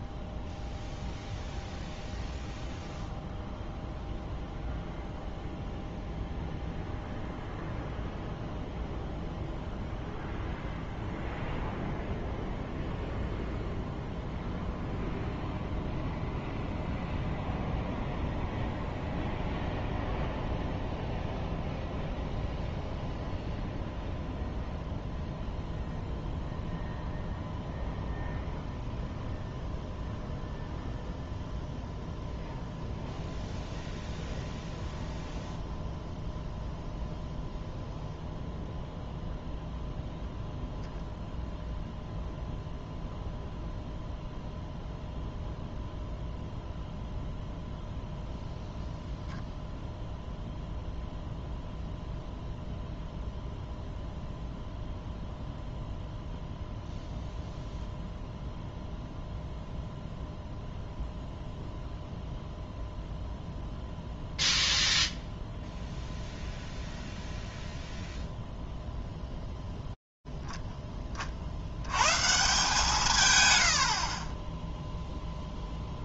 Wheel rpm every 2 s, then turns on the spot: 0, 0, 0, 0, 0, 0, 0, 0, 0, 0, 0, 0, 0, 0, 0, 0, 0, 0, 0, 0, 0, 0, 0, 0, 0, 0, 0, 0, 0, 0, 0, 0, 0, 0, 0, 20, 150, 0.
none